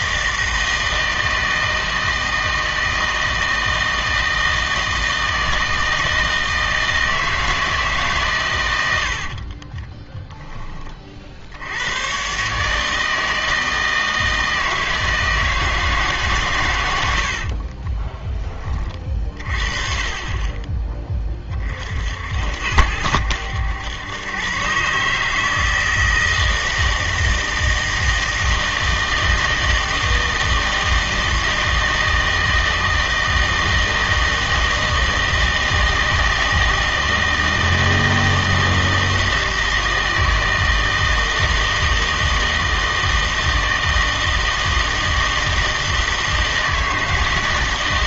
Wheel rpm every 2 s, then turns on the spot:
160, 160, 160, 160, 110, 20, 150, 160, 110, 20, 20, 70, 140, 160, 160, 160, 160, 160, 160, 160, 160, 160, 160, 160.
none